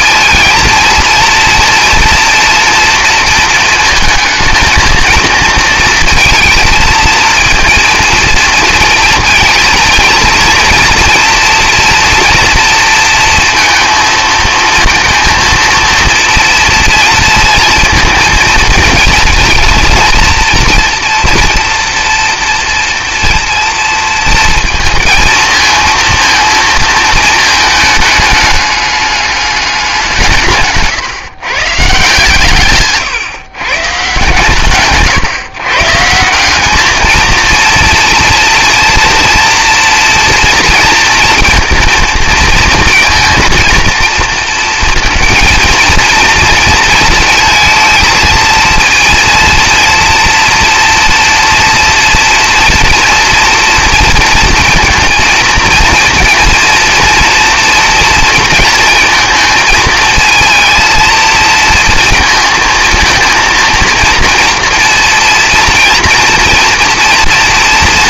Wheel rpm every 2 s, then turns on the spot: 230, 230, 220, 230, 220, 230, 230, 230, 230, 230, 230, 230, 220, 230, 210, 130, 140, 140, 210, 230, 230, 230, 230, 230, 230, 230, 230, 230, 230, 230, 230, 230, 230, 230.
30-32